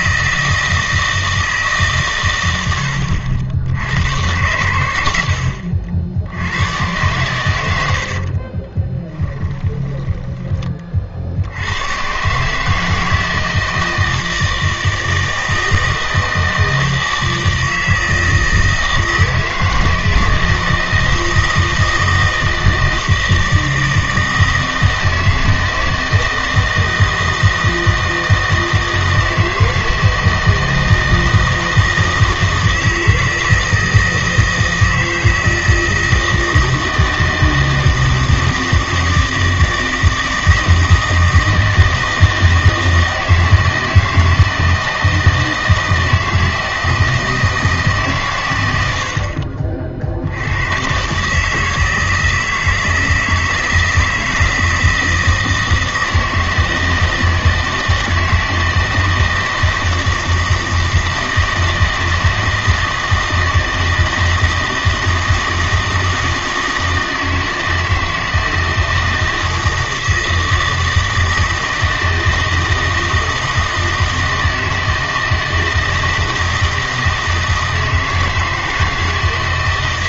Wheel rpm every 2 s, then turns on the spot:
160, 90, 100, 100, 30, 30, 150, 160, 160, 160, 160, 160, 160, 160, 160, 160, 160, 160, 160, 160, 160, 160, 160, 160, 100, 100, 160, 160, 160, 160, 160, 160, 160, 160, 160, 160, 160, 160, 160, 160.
8-10